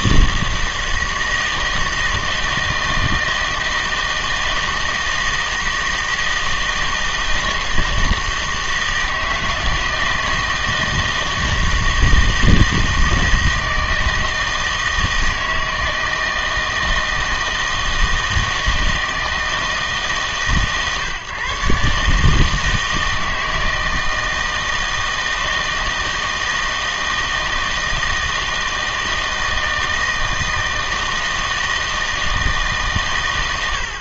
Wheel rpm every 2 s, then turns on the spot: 160, 160, 160, 160, 160, 160, 160, 160, 160, 160, 140, 160, 160, 160, 160, 160, 160.
none